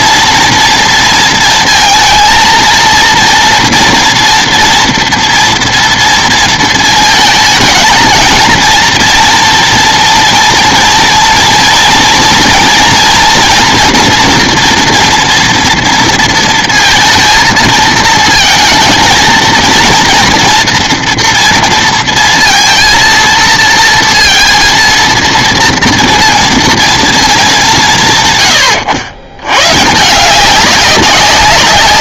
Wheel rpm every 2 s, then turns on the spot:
230, 230, 230, 220, 240, 230, 230, 230, 230, 220, 230, 230, 230, 230, 110, 190.
none